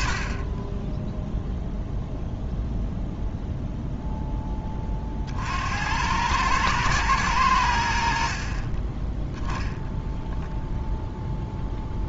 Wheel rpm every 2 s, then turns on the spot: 10, 0, 30, 110, 20, 0.
8-10